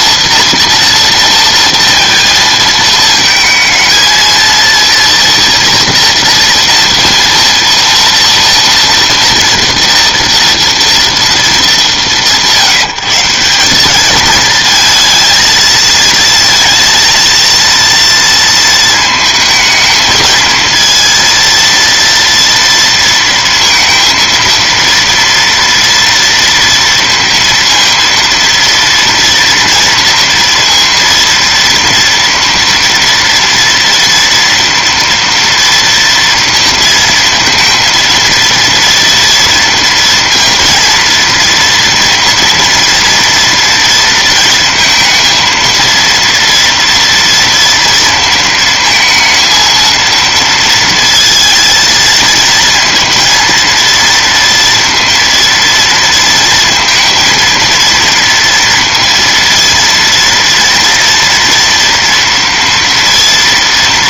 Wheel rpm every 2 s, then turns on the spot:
230, 220, 230, 230, 230, 230, 160, 220, 230, 230, 230, 230, 230, 230, 230, 230, 230, 240, 230, 230, 230, 240, 230, 230, 230, 230, 230, 230, 230, 230, 230, 230.
none